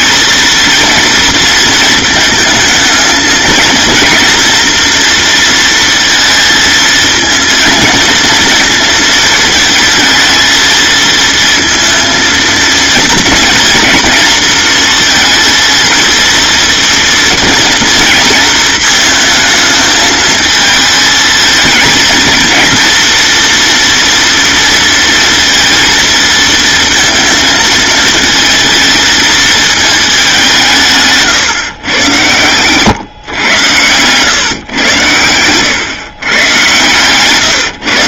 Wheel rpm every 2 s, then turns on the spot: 230, 220, 230, 230, 230, 230, 230, 230, 230, 220, 220, 230, 230, 220, 220, 190, 120, 130, 110.
none